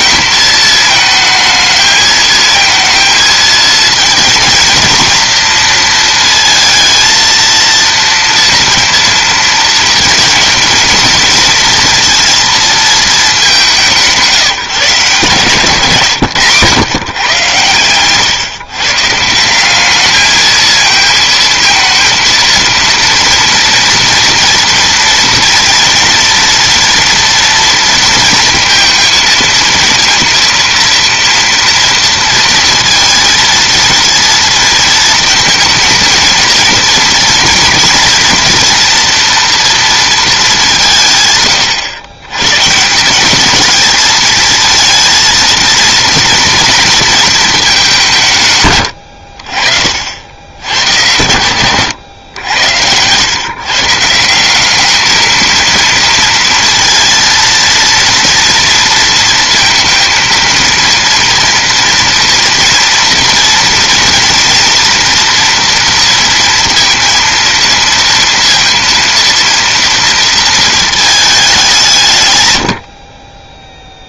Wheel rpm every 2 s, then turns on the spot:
220, 220, 230, 230, 230, 230, 230, 150, 110, 140, 220, 230, 230, 230, 230, 230, 230, 230, 230, 230, 190, 160, 230, 230, 110, 90, 90, 200, 230, 230, 230, 230, 230, 230, 230, 220, 90.
none